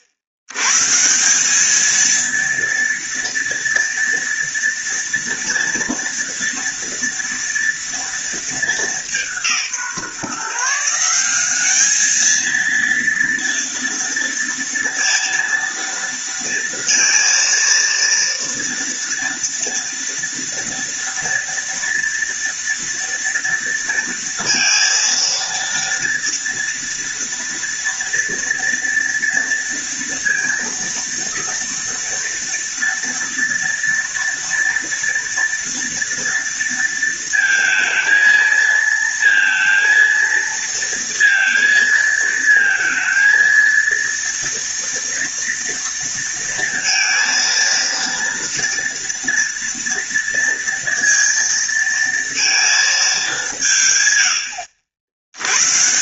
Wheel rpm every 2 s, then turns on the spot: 110, 230, 230, 230, 220, 160, 220, 230, 230, 230, 230, 230, 230, 230, 230, 230, 230, 230, 230, 230, 230, 230, 230, 230, 230, 230, 230, 80.
none